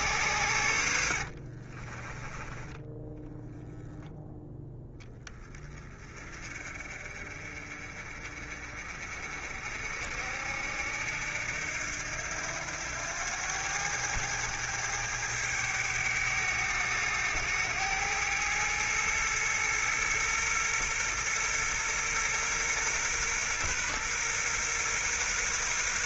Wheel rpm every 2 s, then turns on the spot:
80, 10, 10, 40, 50, 70, 90, 100, 100, 110, 120, 120, 120.
0-2